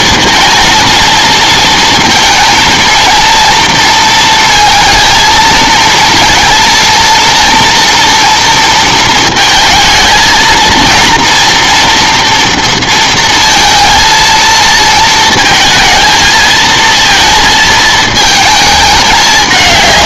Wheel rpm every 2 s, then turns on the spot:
220, 230, 230, 230, 230, 230, 230, 230, 230, 220.
none